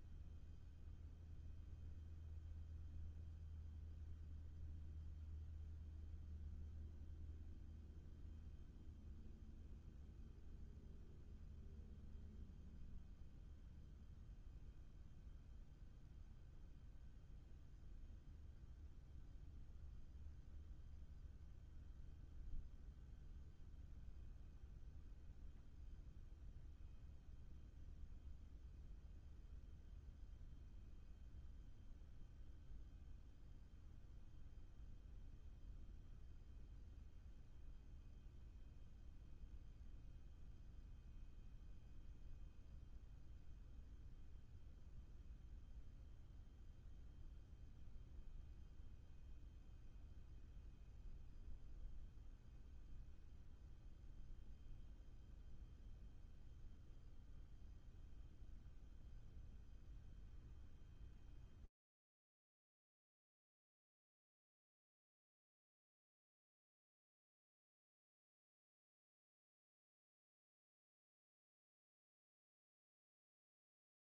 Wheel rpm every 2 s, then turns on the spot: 0, 0, 0, 0, 0, 0, 0, 0, 0, 0, 0, 0, 0, 0, 0, 0, 0, 0, 0, 0, 0, 0, 0, 0, 0, 0, 0, 0, 0, 0, 0, 0, 0, 0, 0, 0, 0.
none